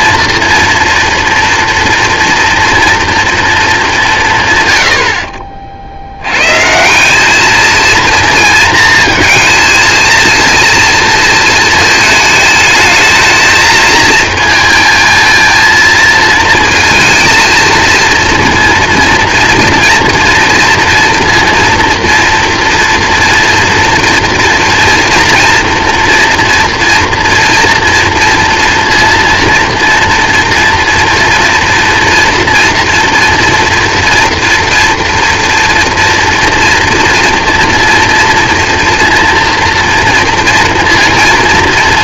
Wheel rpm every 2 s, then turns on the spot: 240, 230, 100, 150, 230, 230, 220, 230, 230, 230, 240, 230, 240, 230, 230, 230, 230, 240, 230, 240, 230.
none